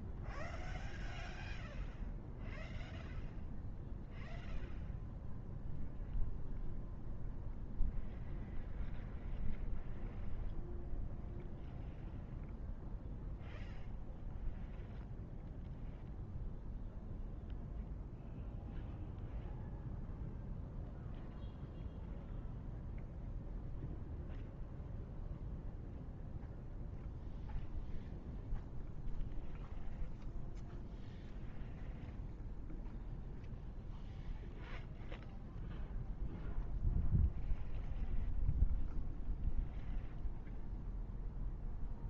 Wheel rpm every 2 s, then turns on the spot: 0, 0, 0, 0, 0, 0, 0, 0, 0, 0, 0, 0, 0, 0, 0, 0, 0, 0, 0, 0, 0.
none